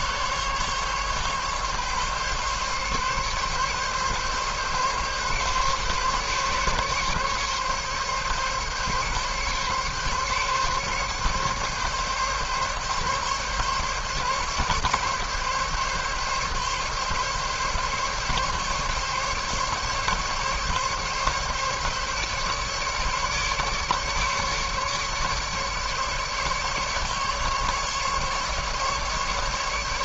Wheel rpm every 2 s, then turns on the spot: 140, 140, 140, 140, 140, 140, 140, 140, 140, 140, 140, 140, 150, 140, 140.
none